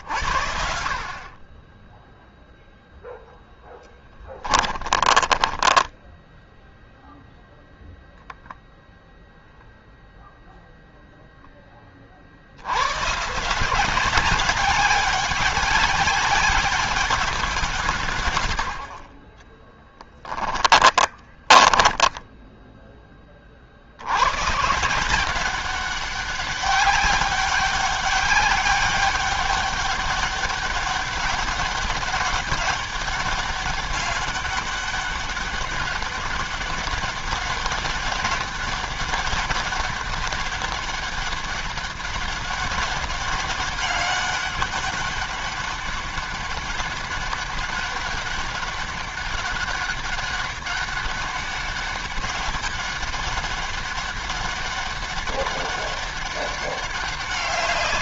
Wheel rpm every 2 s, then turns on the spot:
50, 0, 20, 0, 0, 0, 80, 200, 200, 60, 10, 10, 120, 200, 200, 200, 200, 200, 200, 200, 200, 200, 200, 200, 200, 200, 200, 200, 200.
4-6 20-22